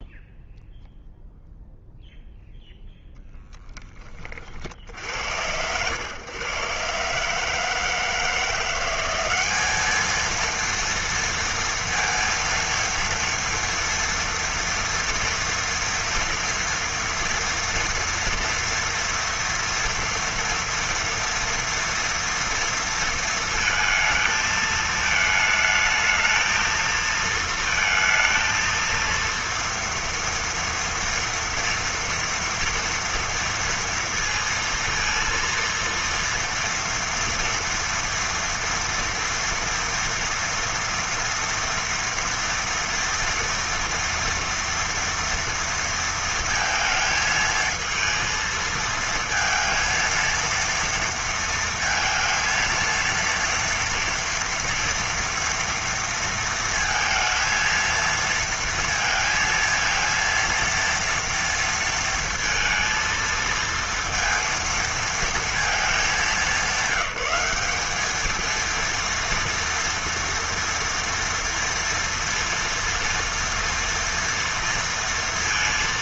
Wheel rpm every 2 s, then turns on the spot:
0, 10, 70, 130, 170, 230, 230, 230, 230, 230, 230, 230, 220, 220, 230, 230, 230, 230, 230, 230, 230, 230, 230, 220, 230, 230, 230, 230, 230, 230, 230, 230, 230, 190, 230, 230, 230, 230.
none